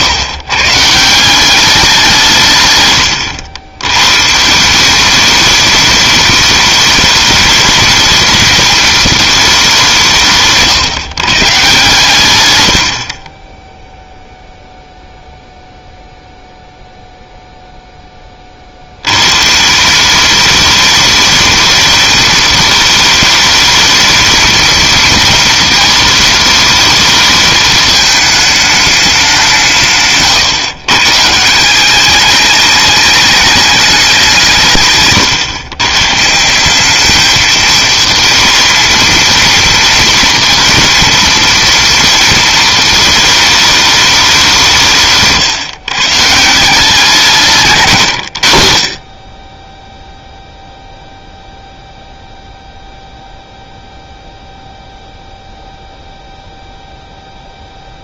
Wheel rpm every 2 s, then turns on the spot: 140, 130, 170, 210, 220, 150, 100, 0, 0, 60, 210, 220, 230, 220, 210, 130, 210, 150, 180, 230, 230, 220, 170, 170, 70, 0, 0, 0, 0.
none